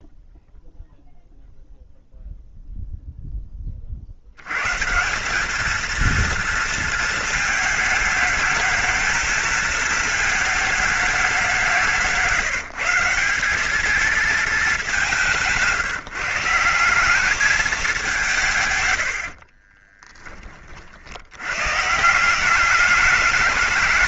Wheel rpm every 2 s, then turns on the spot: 0, 0, 100, 230, 220, 220, 170, 220, 170, 140, 30, 180.
none